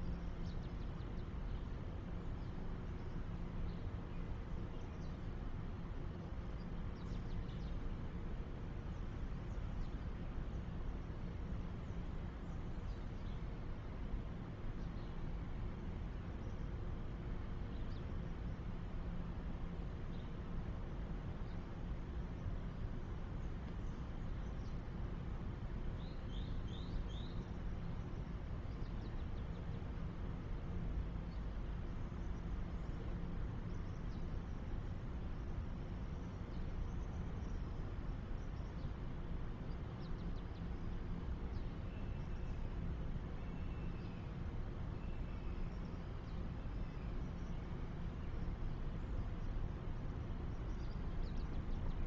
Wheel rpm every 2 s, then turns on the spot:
0, 0, 0, 0, 0, 0, 0, 0, 0, 0, 0, 0, 0, 0, 0, 0, 0, 0, 0, 0, 0, 0, 0, 0, 0, 0.
none